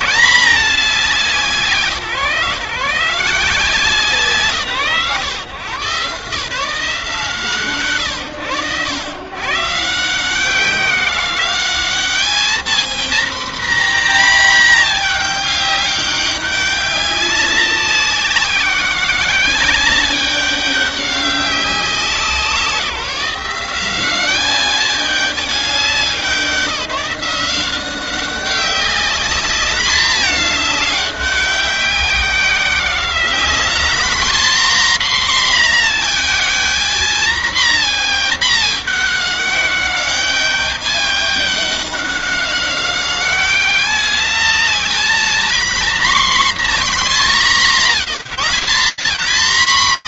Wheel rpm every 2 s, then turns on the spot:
170, 140, 140, 140, 110, 170, 220, 230, 200, 190, 200, 180, 190, 190, 190, 210, 190, 250, 230, 210, 200, 190, 220, 220, 180.
none